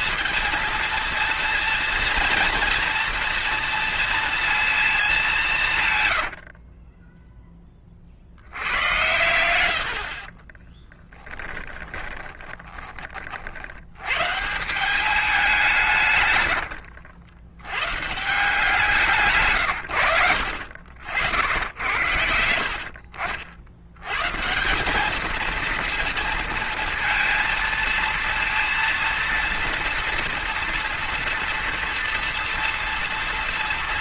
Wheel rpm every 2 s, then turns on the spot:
230, 230, 230, 70, 70, 40, 20, 140, 110, 170, 70, 90, 140, 230, 230, 230, 230.
6-8 12-14 16-18